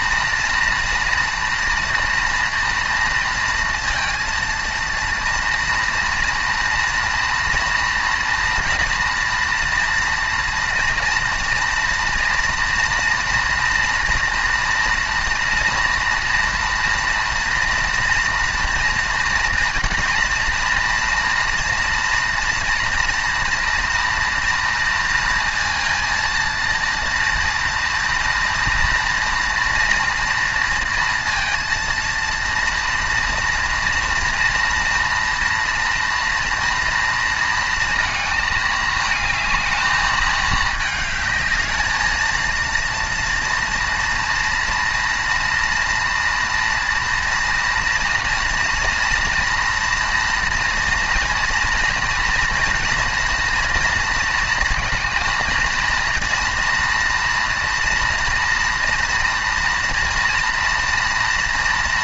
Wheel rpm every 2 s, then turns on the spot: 230, 230, 230, 230, 230, 230, 230, 240, 230, 230, 230, 240, 240, 230, 230, 230, 230, 230, 230, 220, 210, 230, 230, 230, 230, 230, 230, 230, 230, 230, 230.
none